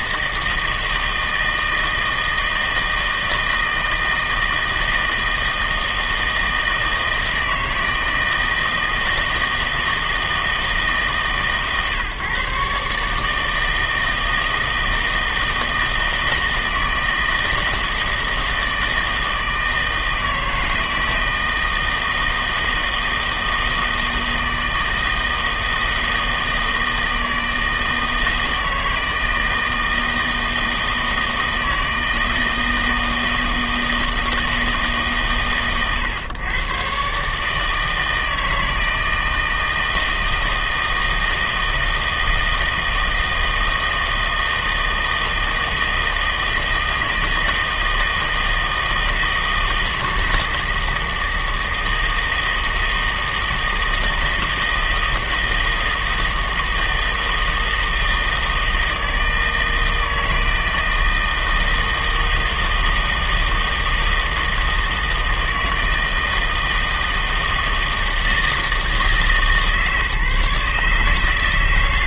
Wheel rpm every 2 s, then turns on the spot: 160, 160, 160, 160, 160, 160, 140, 160, 160, 160, 160, 160, 160, 160, 160, 160, 160, 160, 120, 160, 160, 160, 160, 160, 160, 160, 160, 160, 160, 160, 160, 160, 160, 160, 160, 150.
none